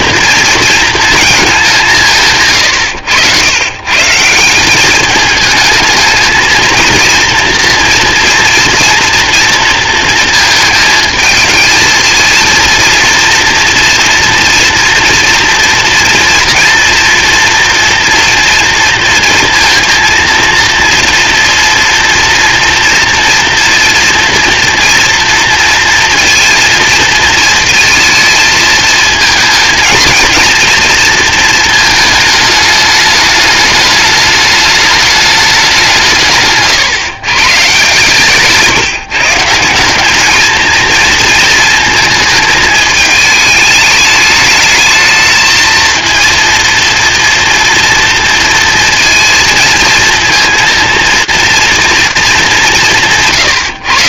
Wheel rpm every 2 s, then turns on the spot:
230, 120, 190, 230, 240, 230, 230, 230, 230, 230, 230, 230, 230, 230, 220, 230, 220, 210, 150, 150, 230, 220, 220, 230, 230, 230, 200.
36-38